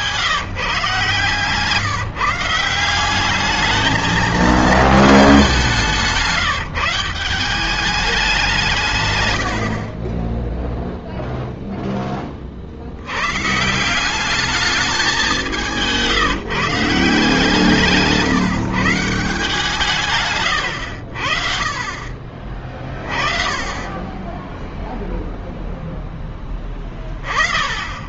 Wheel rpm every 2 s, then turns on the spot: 140, 190, 210, 170, 120, 0, 70, 210, 160, 150, 90, 20, 10, 10.
none